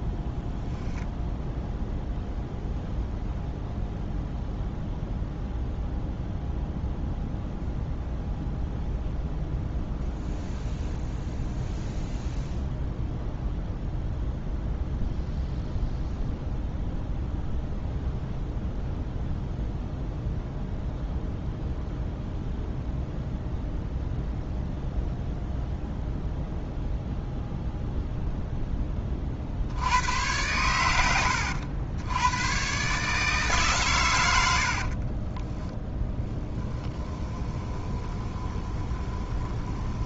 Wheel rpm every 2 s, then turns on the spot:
0, 0, 0, 0, 0, 0, 0, 0, 0, 0, 0, 0, 0, 0, 10, 110, 120, 80, 10, 20.
34-40